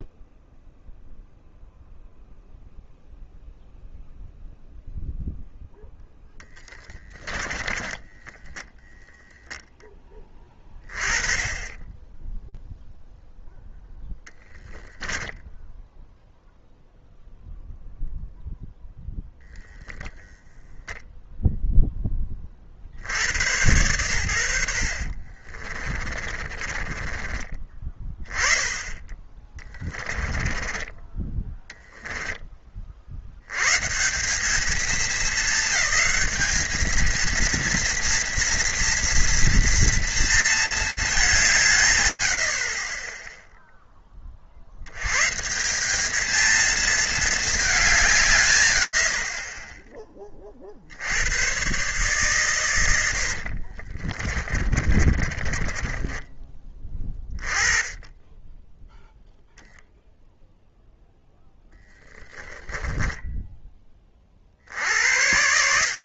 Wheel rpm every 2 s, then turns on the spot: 0, 0, 0, 10, 0, 20, 0, 0, 0, 0, 0, 80, 50, 20, 10, 10, 40, 220, 220, 230, 200, 10, 100, 220, 110, 90, 70, 30, 20, 0, 10, 20, 90.
6-8 24-28 52-56